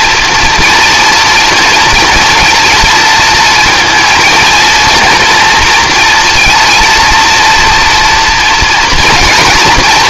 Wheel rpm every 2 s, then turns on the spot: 240, 230, 240, 230, 230.
none